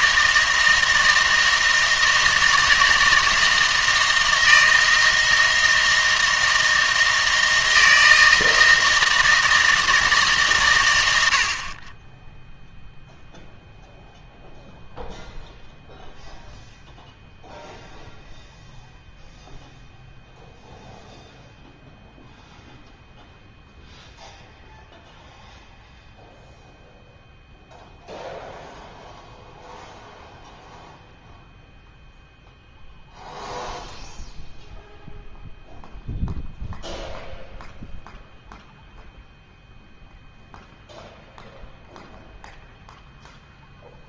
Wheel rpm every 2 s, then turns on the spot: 160, 160, 160, 160, 160, 120, 0, 0, 0, 0, 0, 0, 0, 0, 0, 0, 0, 0, 0, 0, 0, 0.
none